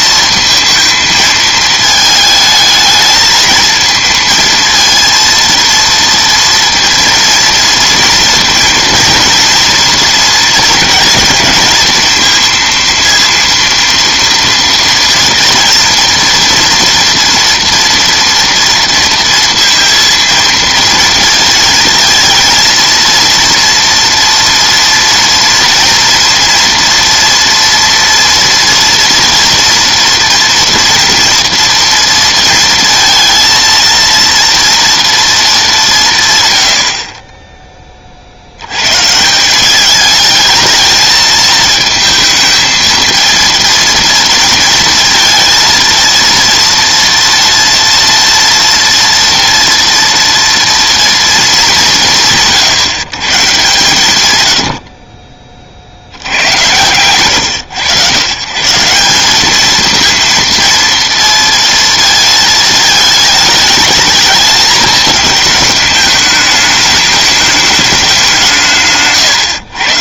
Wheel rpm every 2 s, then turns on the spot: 220, 220, 230, 230, 230, 230, 230, 230, 230, 230, 230, 230, 230, 230, 230, 230, 230, 230, 100, 100, 220, 220, 220, 230, 230, 230, 130, 100, 100, 150, 230, 220, 210, 210, 170.
56-58 68-70